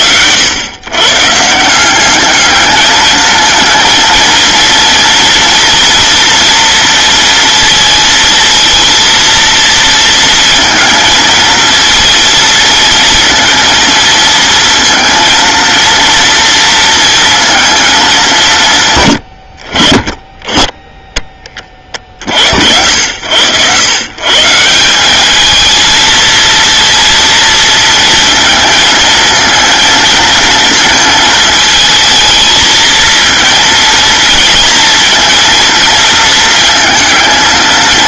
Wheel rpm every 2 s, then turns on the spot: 100, 220, 230, 230, 230, 220, 230, 230, 230, 150, 10, 70, 160, 230, 230, 230, 220, 220, 220.
none